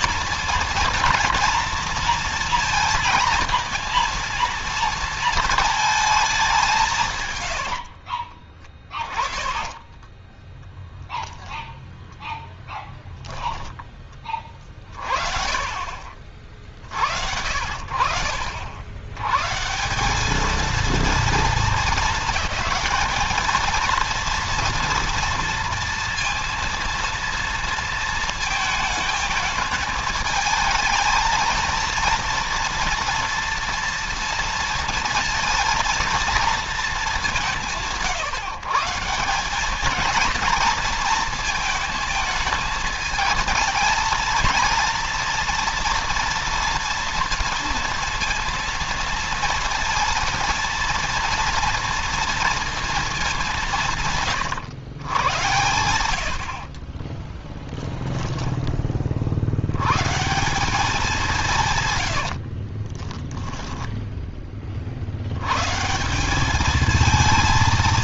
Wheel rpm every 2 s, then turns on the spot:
230, 230, 230, 180, 20, 0, 10, 30, 80, 80, 230, 220, 230, 230, 220, 220, 230, 230, 220, 160, 230, 220, 230, 230, 230, 230, 230, 110, 30, 20, 180, 30, 50, 220.
8-10 56-58 62-64